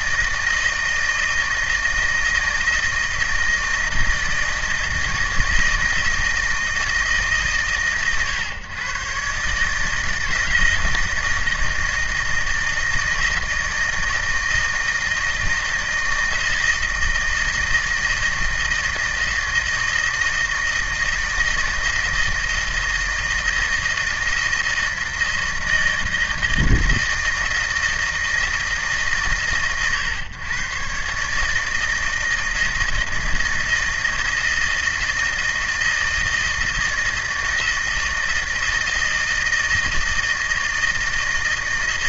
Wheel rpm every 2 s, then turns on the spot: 160, 160, 160, 160, 120, 160, 160, 160, 160, 160, 160, 160, 160, 160, 150, 120, 160, 160, 160, 160, 160.
none